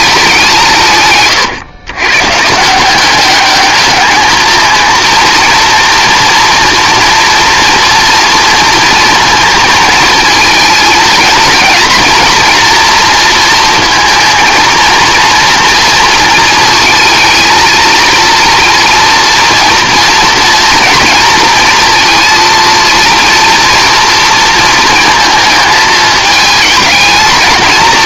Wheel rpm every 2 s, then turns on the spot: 160, 170, 230, 230, 230, 220, 230, 230, 220, 230, 230, 230, 230, 220.
none